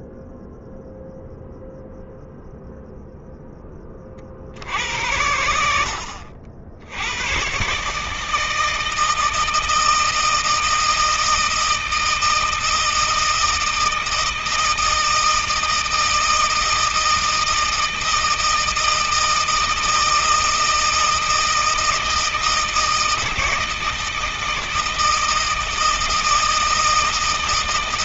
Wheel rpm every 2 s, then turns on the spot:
0, 0, 60, 90, 160, 160, 160, 160, 160, 160, 160, 160, 160, 150.
none